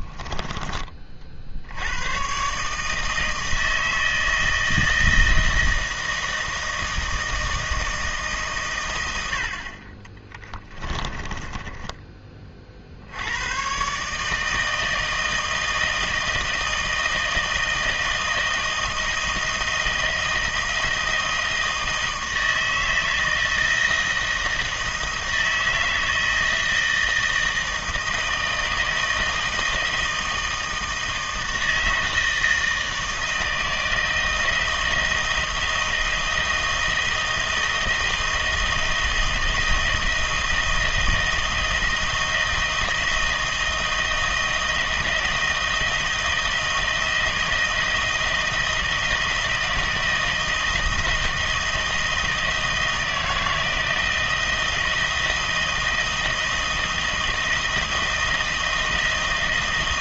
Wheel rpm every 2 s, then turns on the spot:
20, 150, 160, 160, 120, 20, 40, 160, 160, 160, 160, 160, 160, 160, 160, 160, 160, 160, 160, 160, 170, 160, 170, 160, 160, 160, 160, 160, 160, 160.
10-12